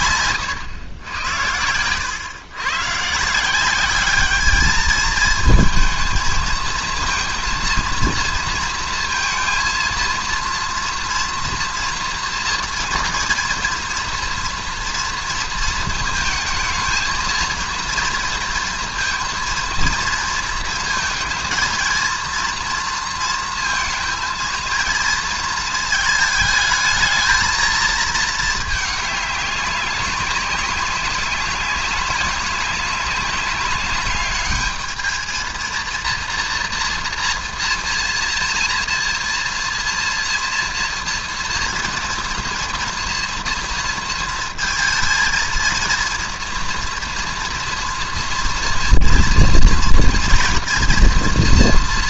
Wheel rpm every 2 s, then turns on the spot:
120, 110, 210, 220, 230, 230, 230, 230, 220, 230, 230, 230, 230, 210, 220, 190, 190, 200, 230, 230, 230, 230, 230, 230, 230, 240.
none